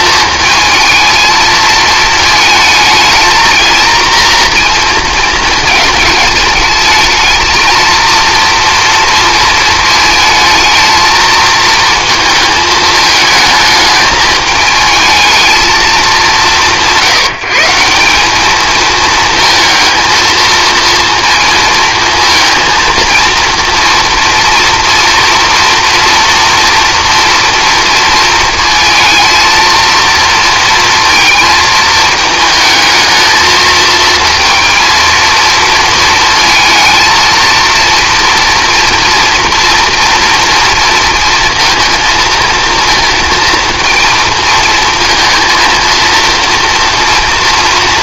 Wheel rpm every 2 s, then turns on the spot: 220, 220, 230, 210, 230, 220, 220, 220, 180, 220, 230, 220, 230, 230, 230, 230, 220, 230, 220, 230, 230, 230, 230, 240.
none